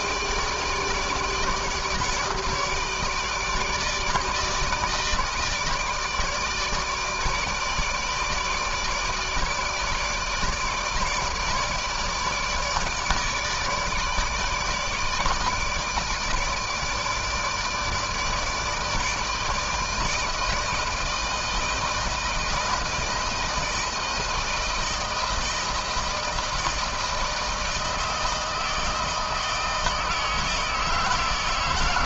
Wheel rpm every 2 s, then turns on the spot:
160, 150, 160, 150, 160, 160, 160, 150, 160, 160, 160, 160, 160, 160, 160, 160.
none